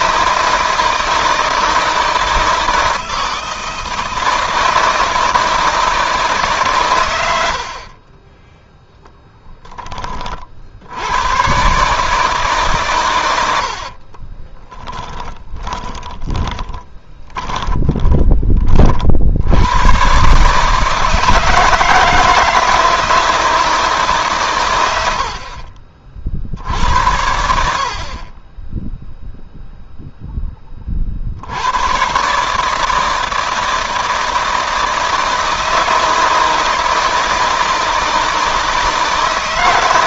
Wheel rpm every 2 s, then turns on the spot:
160, 160, 160, 120, 0, 90, 130, 20, 30, 60, 150, 160, 100, 80, 10, 40, 160, 160, 160, 160.
14-18